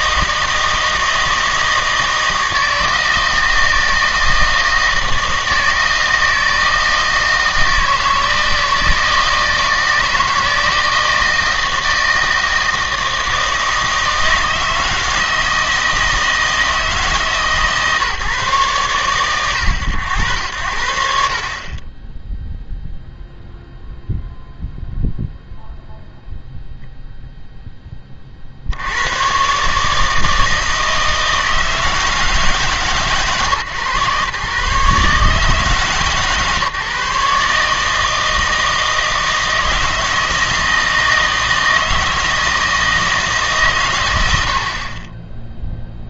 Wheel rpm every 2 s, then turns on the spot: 160, 160, 160, 160, 160, 160, 160, 160, 160, 130, 80, 0, 0, 0, 70, 160, 140, 130, 130, 160, 160, 160, 60.
none